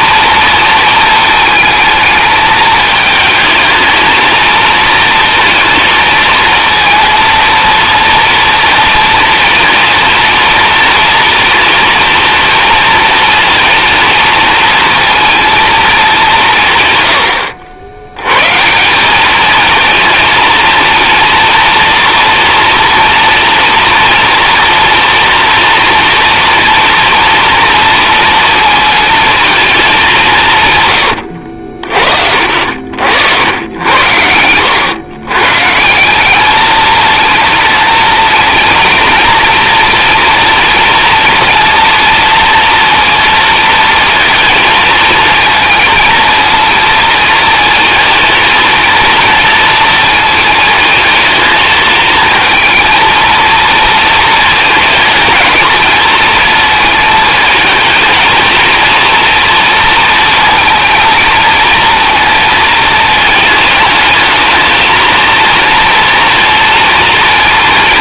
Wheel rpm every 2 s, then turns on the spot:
220, 220, 230, 230, 230, 230, 230, 230, 150, 170, 230, 240, 230, 230, 230, 120, 70, 110, 220, 230, 240, 230, 230, 230, 230, 220, 230, 220, 230, 230, 230, 220, 220, 230.
32-34